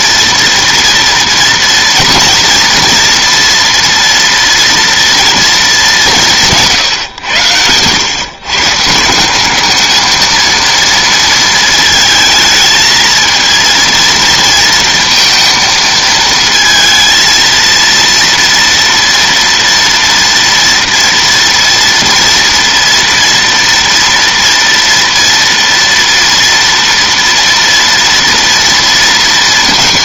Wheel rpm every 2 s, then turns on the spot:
230, 230, 240, 170, 150, 230, 220, 230, 220, 230, 230, 230, 230, 230, 230.
none